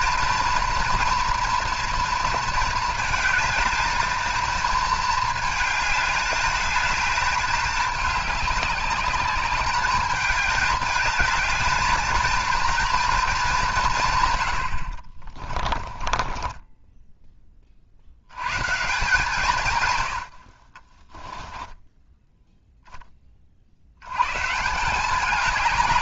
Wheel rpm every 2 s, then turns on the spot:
230, 230, 230, 210, 200, 210, 230, 80, 20, 130, 30, 10, 170.
16-18 20-22